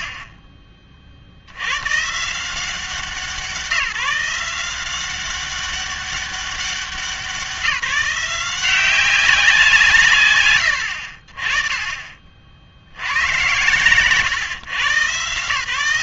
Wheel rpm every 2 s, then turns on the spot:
40, 170, 180, 190, 180, 100, 80, 120.
none